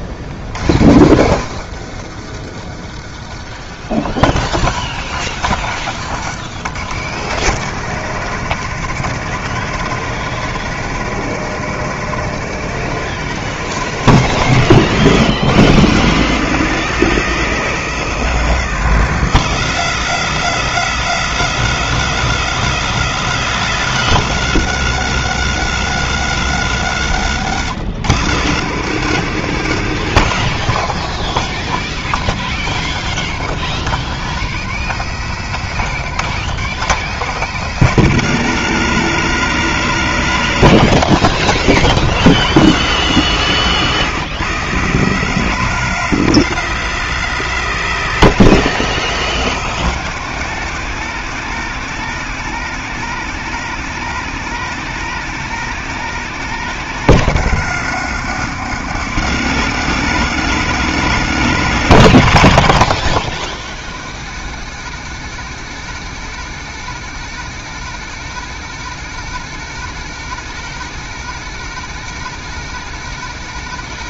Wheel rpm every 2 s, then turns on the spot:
90, 100, 140, 150, 160, 150, 160, 110, 130, 120, 90, 90, 90, 80, 130, 160, 170, 170, 160, 160, 160, 150, 120, 120, 110, 150, 160, 160, 160, 140, 150, 170, 160, 160, 160, 160, 160.
none